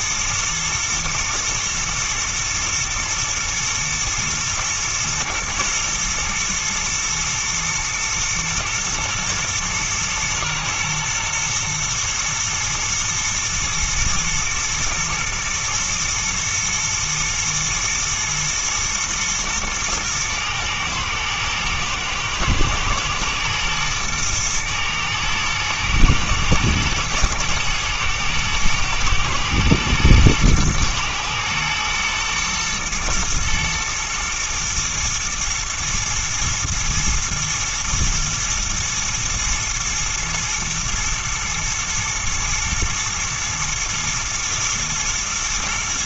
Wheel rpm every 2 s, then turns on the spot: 120, 110, 110, 110, 110, 120, 110, 120, 110, 120, 110, 110, 110, 120, 110, 110, 120, 120, 110, 120, 120, 110, 110.
none